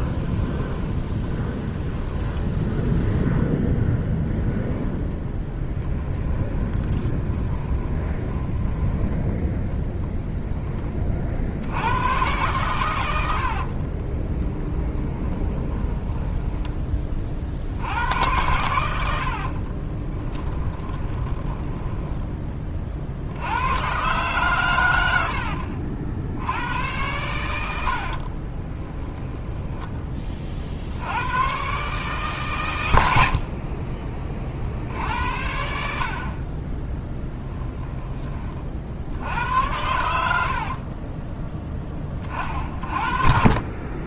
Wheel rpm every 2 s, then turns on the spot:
10, 10, 10, 20, 10, 10, 110, 20, 20, 90, 20, 30, 120, 90, 20, 50, 110, 50, 30, 40, 60, 40.
0-2 6-10 14-16 20-22 28-30 40-42